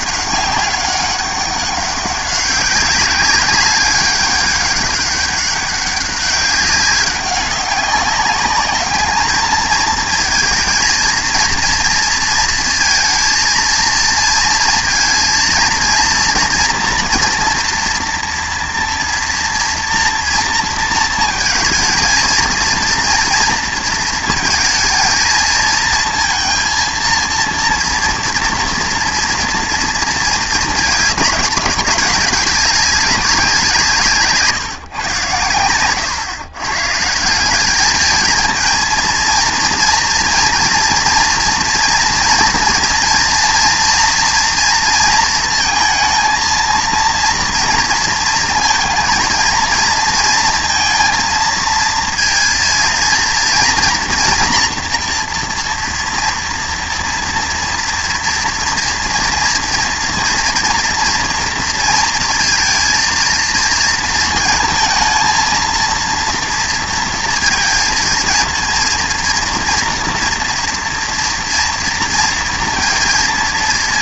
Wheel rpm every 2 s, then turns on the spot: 200, 200, 200, 200, 200, 220, 230, 230, 230, 240, 230, 230, 220, 230, 230, 220, 200, 160, 130, 230, 230, 230, 230, 230, 220, 230, 230, 230, 230, 230, 240, 230, 230, 230, 230, 230, 230.
none